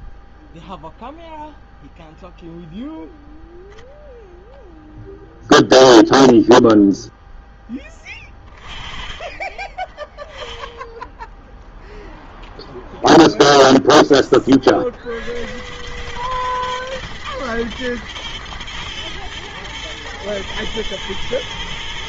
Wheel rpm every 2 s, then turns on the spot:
0, 0, 0, 0, 20, 0, 0, 70, 120, 110, 110.
none